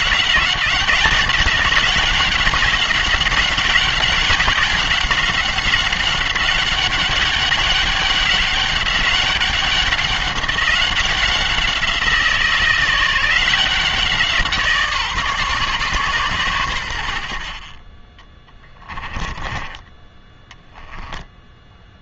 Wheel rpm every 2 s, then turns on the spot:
180, 190, 190, 200, 200, 190, 160, 160, 100, 20, 10.
18-22